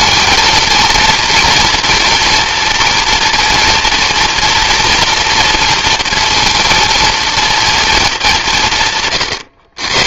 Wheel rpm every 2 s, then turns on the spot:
230, 230, 230, 230, 160.
none